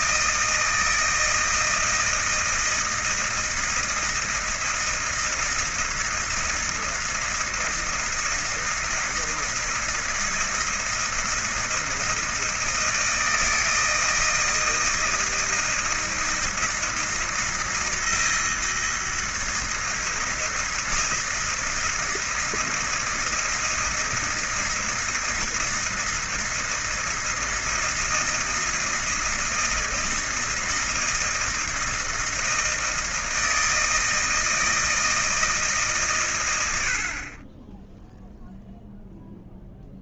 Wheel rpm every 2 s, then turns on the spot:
160, 160, 160, 160, 160, 160, 160, 160, 160, 160, 160, 160, 160, 160, 160, 160, 160, 160, 80, 0.
none